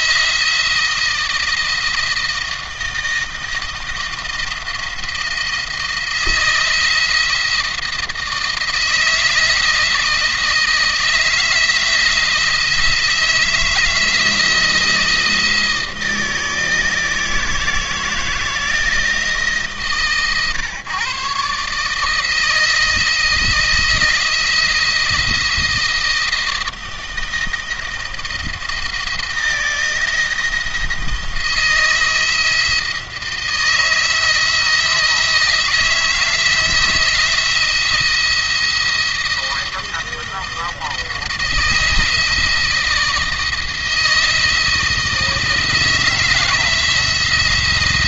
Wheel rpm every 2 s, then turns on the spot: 170, 160, 170, 170, 160, 160, 160, 170, 160, 160, 120, 160, 160, 160, 160, 160, 170, 160, 160, 170, 170, 170, 170, 170.
none